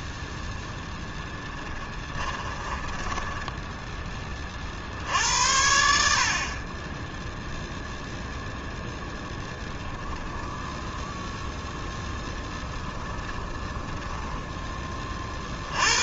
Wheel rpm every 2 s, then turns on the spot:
0, 20, 50, 20, 0, 10, 0, 10.
2-4 10-12